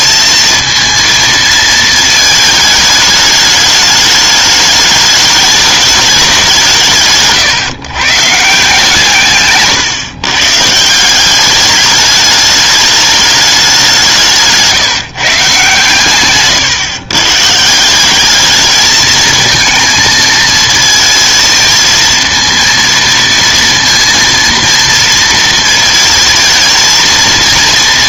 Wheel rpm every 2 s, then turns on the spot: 230, 220, 210, 180, 140, 140, 210, 160, 140, 210, 230, 230, 230, 220.
none